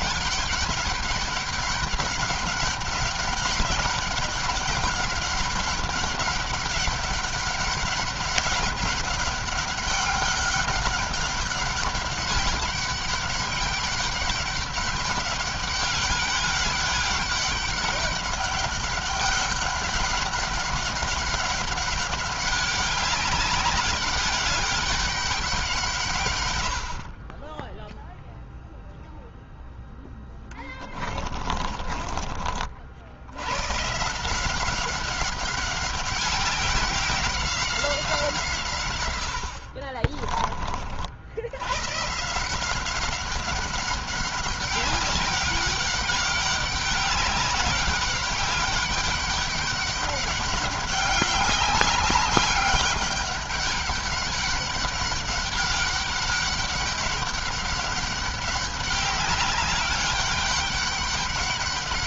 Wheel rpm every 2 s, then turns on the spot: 200, 200, 200, 200, 200, 200, 200, 190, 200, 190, 200, 200, 200, 70, 0, 20, 60, 190, 190, 120, 50, 180, 200, 200, 200, 200, 200, 200, 200, 190, 190.
30-32